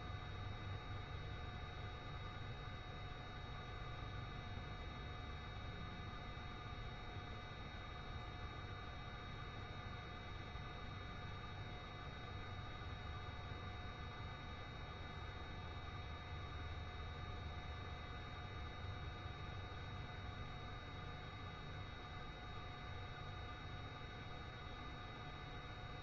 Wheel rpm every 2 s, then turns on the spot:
0, 0, 0, 0, 0, 0, 0, 0, 0, 0, 0, 0, 0.
none